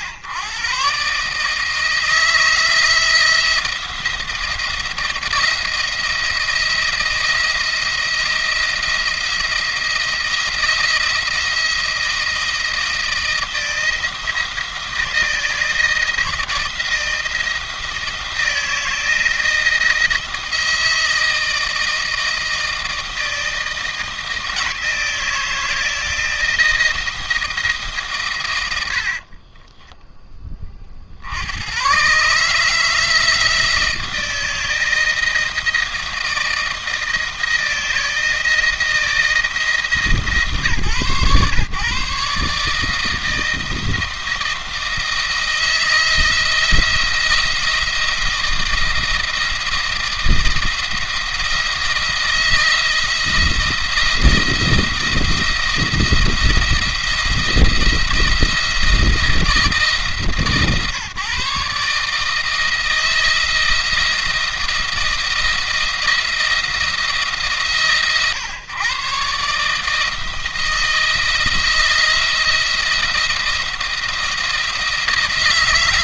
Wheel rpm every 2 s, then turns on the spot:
120, 160, 170, 170, 170, 170, 160, 160, 170, 170, 170, 160, 160, 160, 100, 20, 150, 160, 170, 160, 140, 150, 160, 160, 170, 170, 170, 170, 170, 170, 140, 160, 170, 170, 130, 160, 170, 170.
28-30